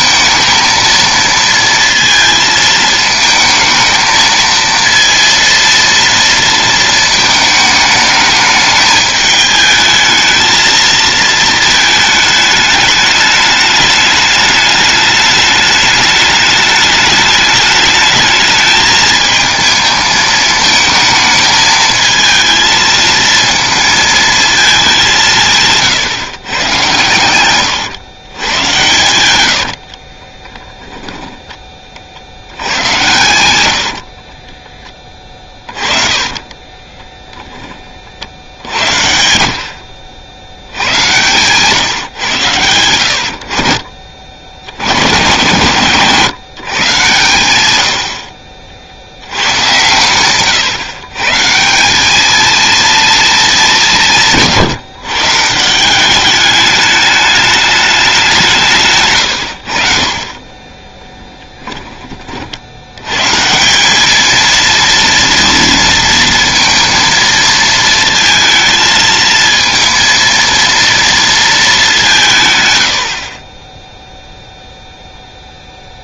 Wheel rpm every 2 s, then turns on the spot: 230, 220, 230, 230, 210, 220, 210, 210, 210, 220, 220, 220, 220, 120, 120, 20, 90, 20, 20, 70, 70, 90, 90, 140, 60, 120, 230, 160, 210, 170, 20, 70, 230, 230, 220, 230, 140, 0.
30-32 36-38 60-62